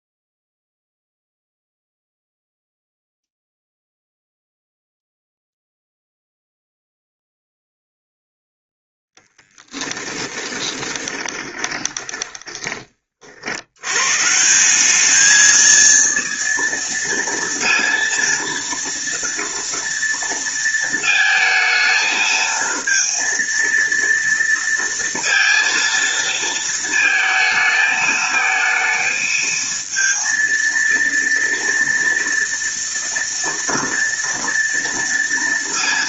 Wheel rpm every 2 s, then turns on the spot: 0, 0, 0, 0, 10, 20, 20, 170, 230, 230, 230, 220, 230, 230, 220, 230, 230, 230.
10-12